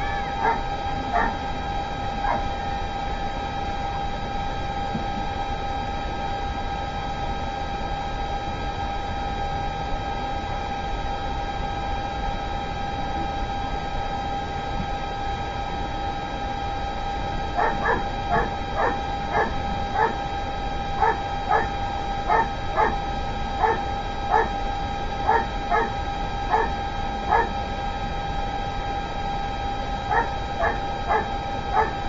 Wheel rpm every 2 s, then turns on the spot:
0, 0, 0, 0, 0, 0, 0, 0, 0, 0, 0, 0, 0, 0, 0, 0.
none